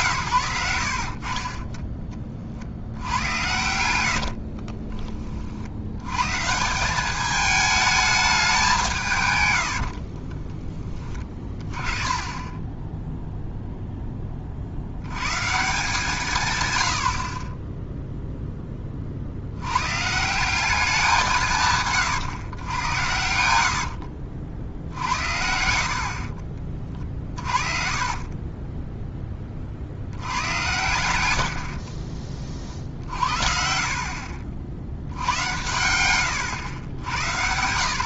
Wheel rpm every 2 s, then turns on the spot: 80, 50, 40, 170, 180, 20, 10, 50, 120, 20, 190, 100, 60, 40, 20, 90, 40, 60, 90.
4-6 12-14 26-30 32-34